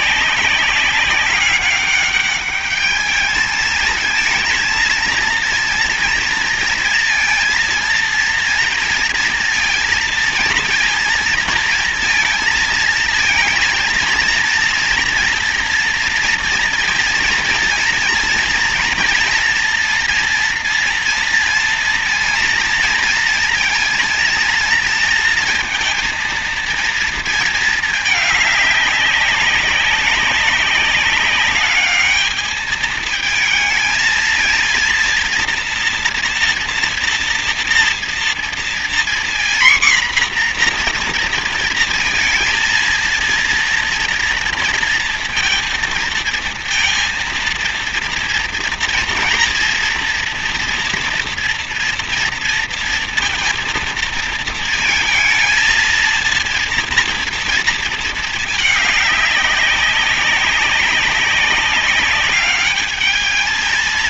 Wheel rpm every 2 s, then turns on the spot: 200, 210, 230, 230, 230, 230, 230, 230, 230, 230, 240, 230, 230, 230, 200, 200, 220, 230, 240, 240, 240, 230, 230, 230, 230, 230, 230, 220, 230, 210, 190, 210.
none